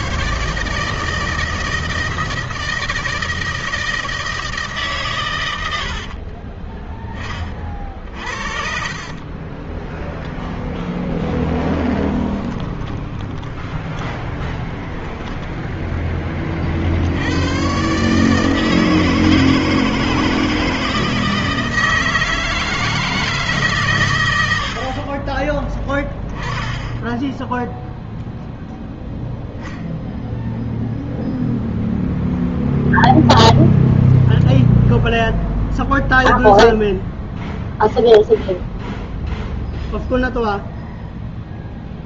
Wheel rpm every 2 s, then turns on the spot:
140, 160, 160, 30, 50, 0, 10, 10, 40, 150, 160, 160, 90, 10, 0, 0, 0, 0, 0, 0, 0.
6-10 12-16